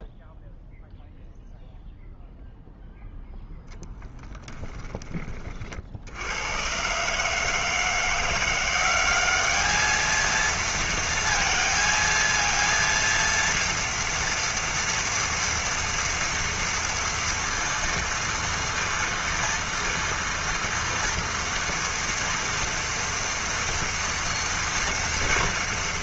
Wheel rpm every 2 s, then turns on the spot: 0, 0, 10, 110, 180, 230, 230, 230, 230, 230, 230, 230, 230.
4-6